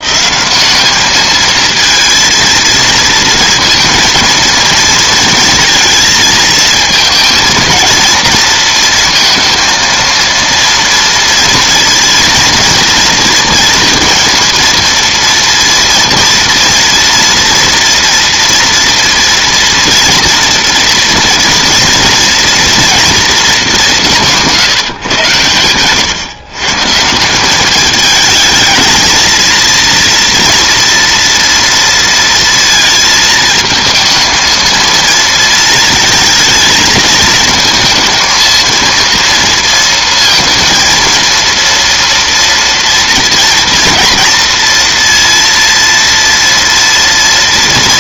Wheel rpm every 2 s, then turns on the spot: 210, 230, 230, 220, 230, 230, 230, 230, 230, 230, 230, 230, 140, 140, 220, 230, 230, 230, 220, 230, 230, 230, 230, 230.
none